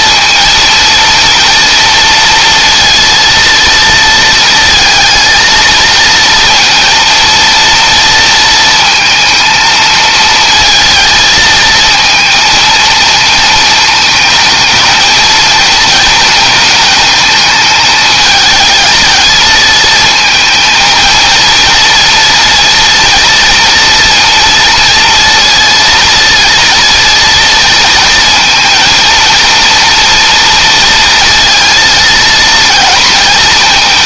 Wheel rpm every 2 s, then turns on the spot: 230, 230, 220, 230, 230, 220, 220, 220, 220, 220, 230, 230, 230, 240, 230, 230, 230.
none